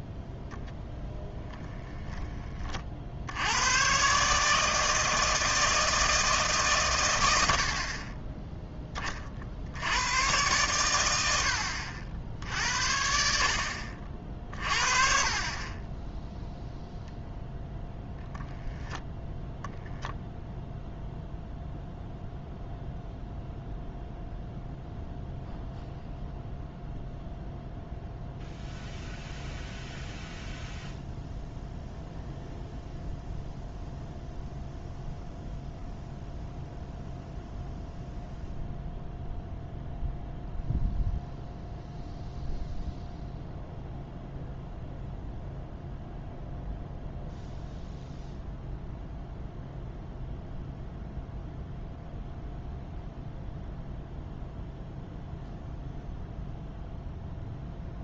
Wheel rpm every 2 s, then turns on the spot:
0, 30, 160, 140, 10, 120, 60, 40, 0, 0, 0, 0, 0, 0, 0, 0, 0, 0, 0, 0, 0, 0, 0, 0, 0, 0, 0, 0, 0.
none